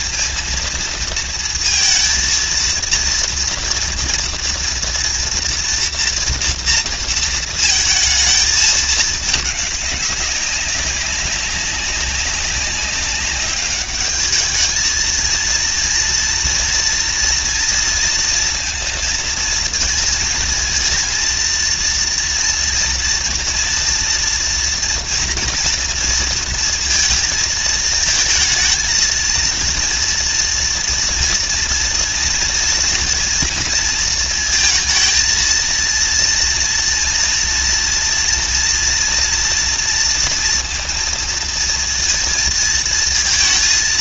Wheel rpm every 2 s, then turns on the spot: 230, 230, 230, 230, 220, 190, 200, 220, 230, 230, 230, 230, 230, 230, 230, 230, 230, 230, 230, 230, 230, 230.
none